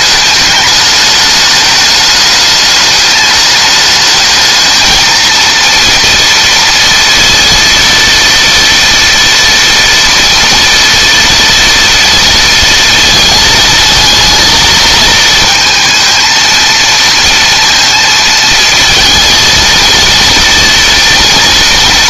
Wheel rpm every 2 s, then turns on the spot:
210, 210, 220, 230, 230, 230, 230, 220, 230, 220, 230.
none